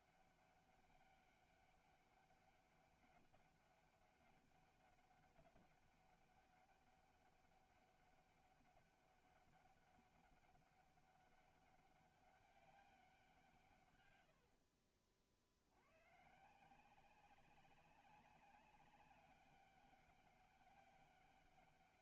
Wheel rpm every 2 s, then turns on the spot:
200, 200, 200, 200, 200, 200, 200, 70, 170, 200, 200.
14-16